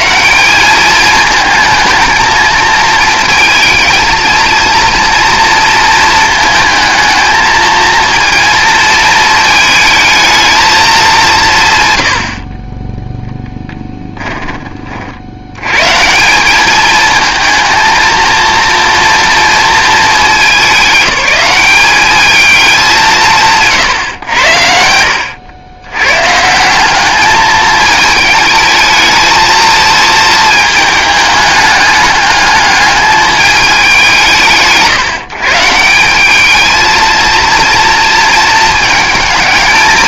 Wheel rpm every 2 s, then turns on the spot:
200, 220, 230, 220, 220, 220, 20, 40, 210, 230, 190, 200, 90, 170, 220, 220, 210, 160, 220, 220.
none